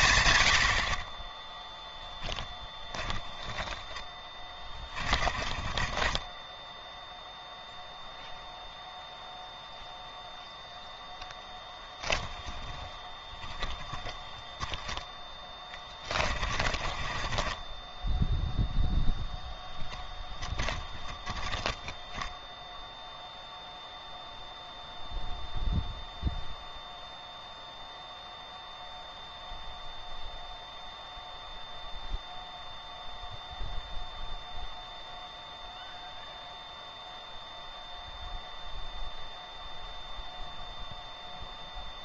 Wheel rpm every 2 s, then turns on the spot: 70, 10, 30, 0, 0, 0, 10, 10, 30, 0, 20, 0, 0, 0, 0, 0, 0, 0, 0, 0, 0.
2-6 12-14 16-18 20-22